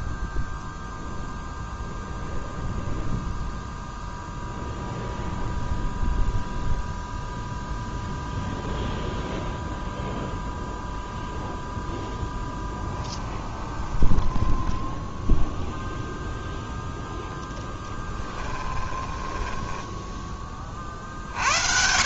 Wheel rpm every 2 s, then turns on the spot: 0, 0, 0, 0, 0, 0, 10, 10, 0, 20, 30.
12-16 18-20